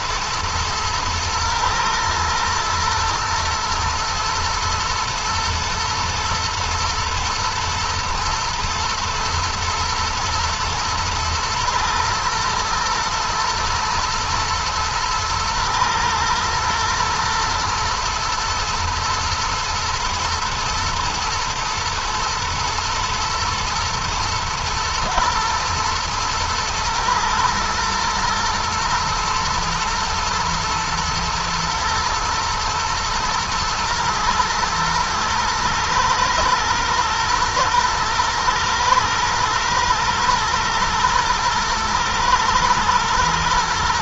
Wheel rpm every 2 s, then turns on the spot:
110, 110, 110, 120, 120, 110, 120, 110, 120, 110, 110, 120, 120, 110, 120, 120, 110, 110, 120, 120, 120, 110.
none